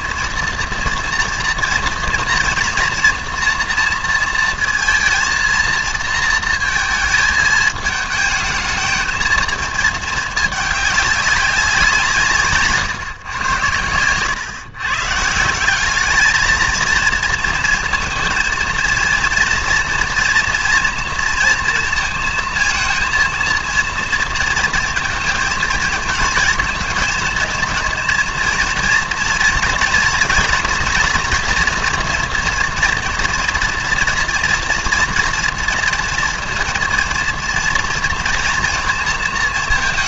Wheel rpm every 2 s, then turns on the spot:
230, 240, 230, 230, 220, 210, 140, 120, 220, 230, 230, 230, 220, 230, 230, 230, 230, 230, 230, 240.
none